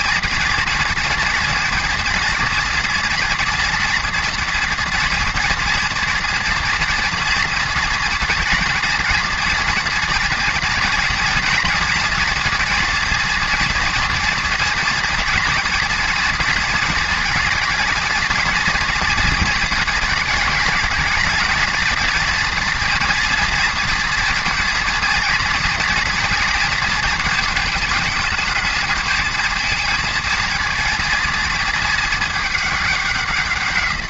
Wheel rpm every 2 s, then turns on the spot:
240, 230, 230, 230, 240, 240, 230, 230, 230, 220, 220, 240, 240, 230, 220, 220, 200.
none